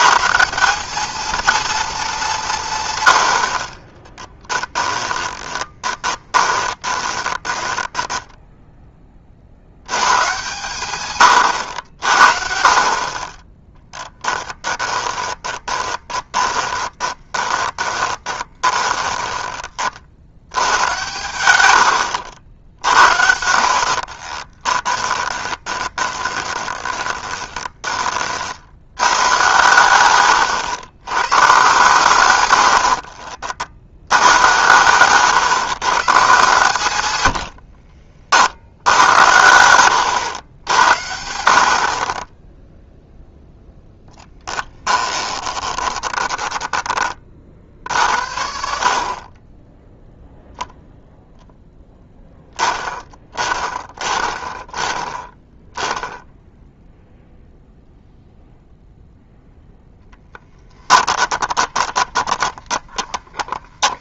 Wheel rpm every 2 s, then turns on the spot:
210, 140, 10, 20, 10, 110, 50, 20, 20, 10, 100, 60, 20, 20, 80, 120, 90, 120, 130, 80, 80, 0, 10, 20, 50, 0, 10, 20, 0, 0, 20, 20.
4-8 14-20 22-28 32-34 44-46 60-64